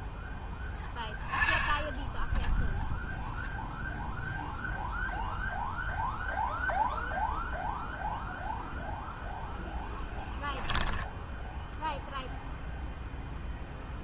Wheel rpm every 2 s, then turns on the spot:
10, 0, 0, 0, 0, 10, 0.
10-12